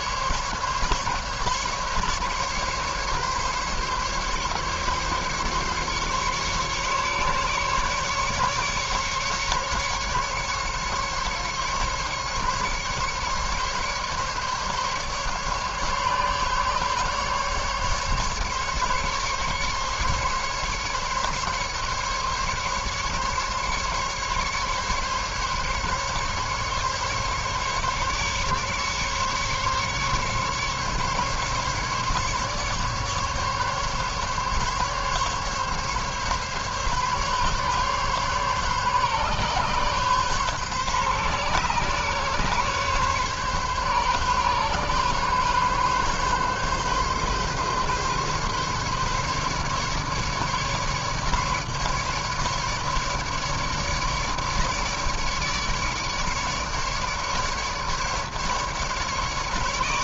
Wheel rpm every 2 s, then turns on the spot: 140, 140, 140, 140, 140, 140, 140, 140, 140, 140, 140, 140, 140, 140, 140, 140, 140, 140, 140, 140, 140, 130, 140, 140, 140, 150, 150, 150, 150, 140.
none